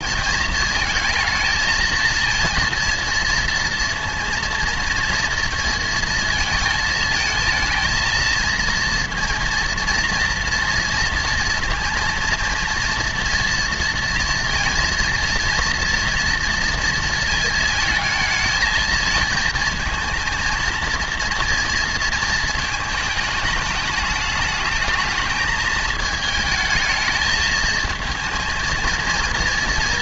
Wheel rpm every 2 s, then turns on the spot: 220, 230, 230, 230, 230, 230, 230, 230, 230, 220, 230, 220, 220, 220, 230.
none